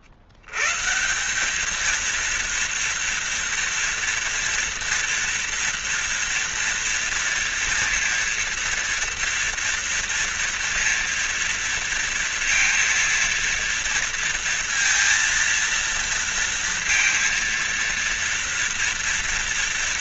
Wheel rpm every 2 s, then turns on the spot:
130, 230, 230, 230, 230, 230, 230, 230, 230, 230.
none